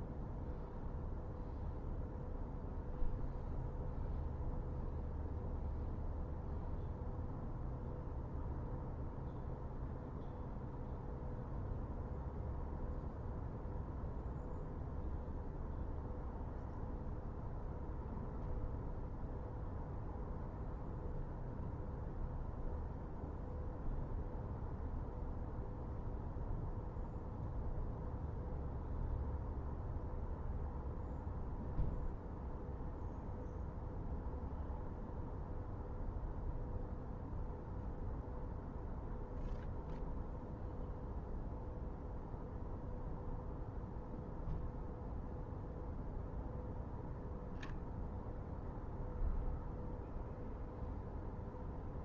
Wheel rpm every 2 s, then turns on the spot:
0, 0, 0, 0, 0, 0, 0, 0, 0, 0, 0, 0, 0, 0, 0, 0, 0, 0, 0, 0, 0, 0, 0, 0, 0, 0.
none